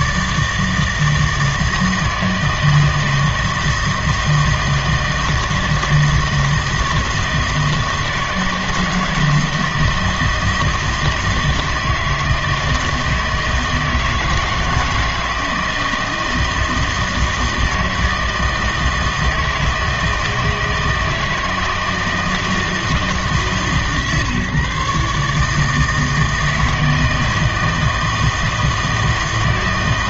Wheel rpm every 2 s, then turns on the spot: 160, 160, 160, 160, 160, 160, 160, 160, 160, 160, 160, 160, 140, 160, 160.
none